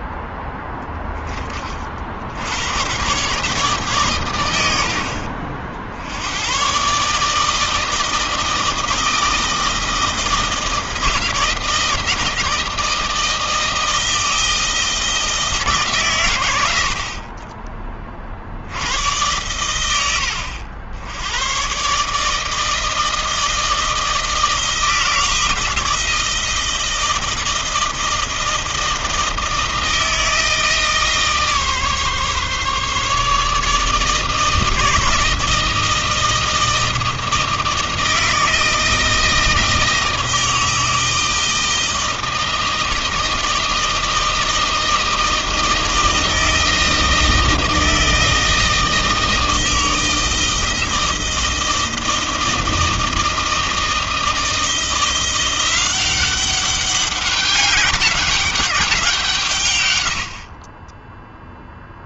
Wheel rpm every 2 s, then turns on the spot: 20, 140, 50, 140, 160, 160, 160, 160, 40, 110, 100, 160, 160, 160, 160, 150, 150, 160, 160, 160, 160, 160, 160, 160, 160, 160, 160, 170, 200, 170, 10.
none